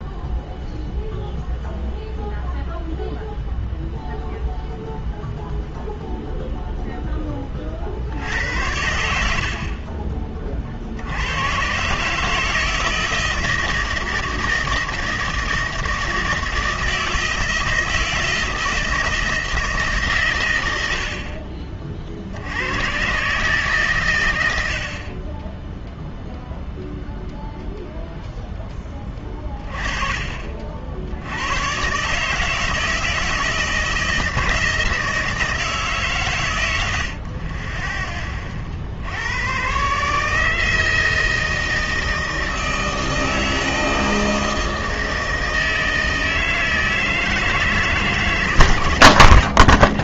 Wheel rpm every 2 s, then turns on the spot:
0, 0, 0, 0, 80, 40, 160, 160, 160, 160, 100, 90, 80, 0, 10, 50, 160, 160, 100, 40, 160, 160, 160, 160, 140.
none